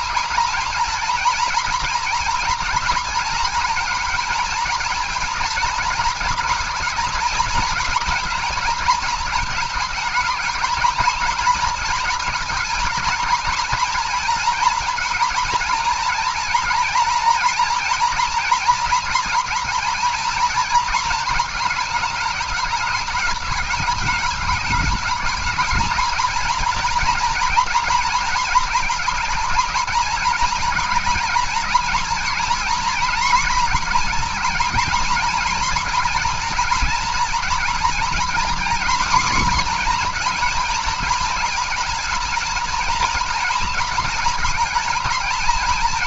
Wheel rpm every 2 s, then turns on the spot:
230, 230, 220, 220, 220, 210, 220, 230, 230, 230, 220, 200, 210, 230, 230, 230, 240, 230, 230, 250, 220, 230, 230.
none